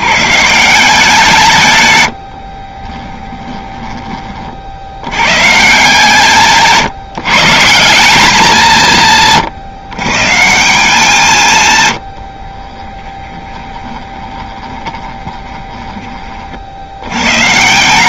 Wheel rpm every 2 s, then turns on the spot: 170, 20, 70, 160, 170, 180, 20, 20, 100.
2-4 12-16